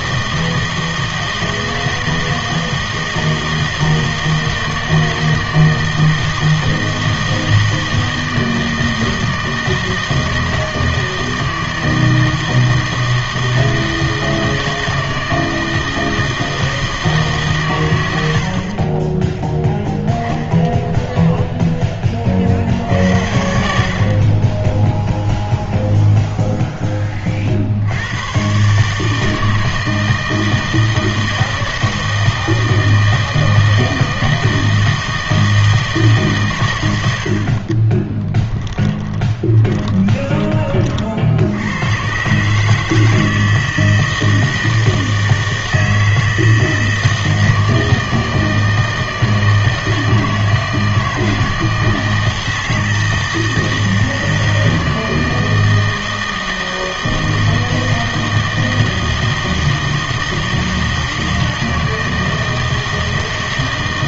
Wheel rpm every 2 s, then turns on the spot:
160, 160, 160, 160, 160, 160, 160, 160, 160, 70, 0, 50, 20, 0, 120, 160, 160, 160, 130, 20, 30, 140, 160, 160, 160, 160, 160, 160, 160, 160, 160, 160.
38-40